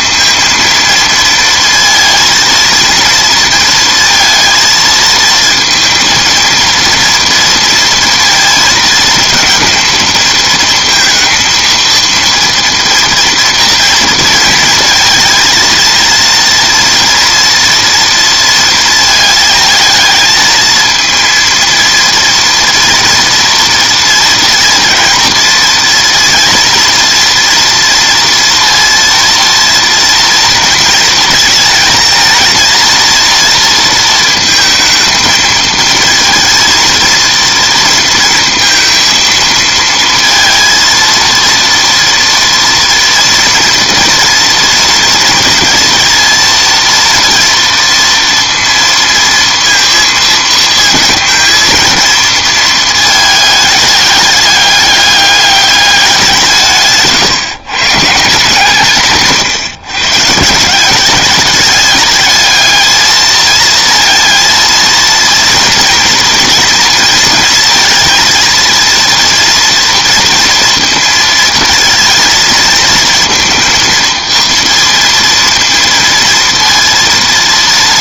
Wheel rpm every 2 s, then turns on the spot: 220, 230, 230, 230, 230, 230, 240, 230, 230, 230, 220, 230, 230, 230, 230, 230, 230, 230, 230, 230, 230, 230, 230, 230, 230, 220, 220, 200, 160, 160, 170, 220, 230, 230, 230, 230, 230, 230, 230.
none